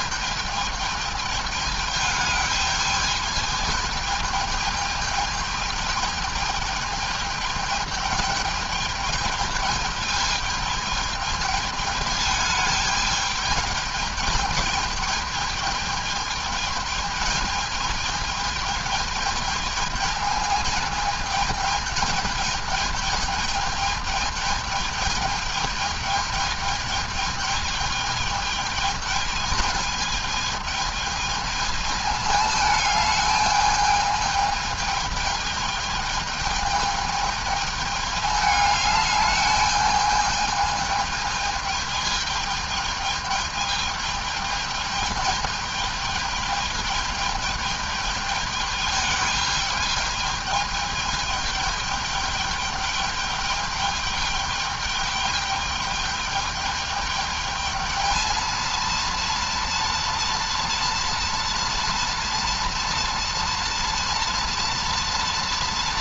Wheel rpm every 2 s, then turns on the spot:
210, 210, 210, 220, 210, 210, 220, 220, 220, 210, 220, 220, 210, 210, 210, 220, 220, 220, 210, 210, 210, 220, 220, 210, 210, 210, 210, 210, 210, 220, 230, 230, 230.
none